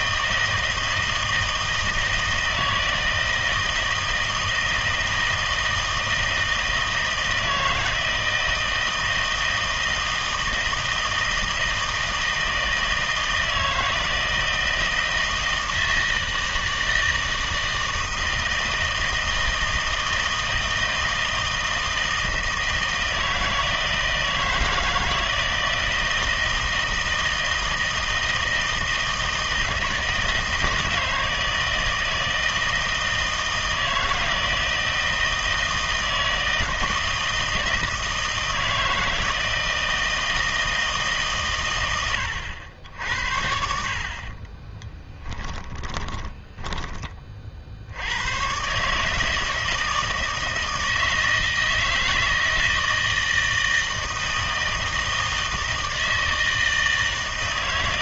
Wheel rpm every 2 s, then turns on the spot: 160, 160, 160, 160, 160, 160, 160, 160, 160, 160, 160, 160, 160, 160, 160, 160, 160, 160, 160, 160, 160, 80, 20, 20, 140, 160, 160, 160, 160.
44-48